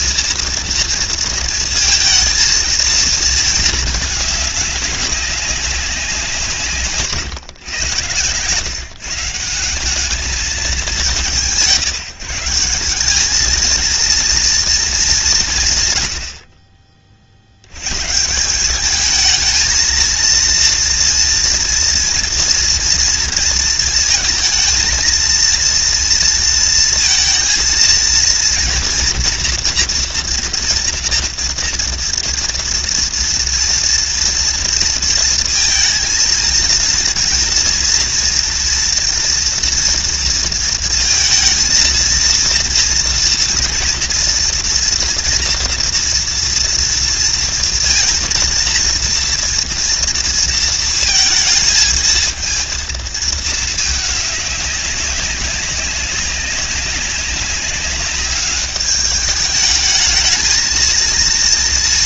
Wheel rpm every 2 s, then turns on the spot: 230, 220, 200, 140, 160, 180, 200, 210, 40, 200, 230, 230, 230, 230, 240, 240, 240, 230, 230, 230, 230, 230, 230, 230, 230, 230, 230, 190, 190, 210, 230.
none